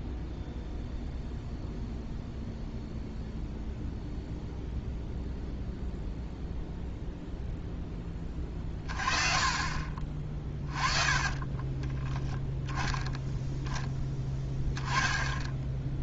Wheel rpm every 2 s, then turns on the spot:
0, 0, 0, 0, 30, 20, 10, 10.
10-12 14-16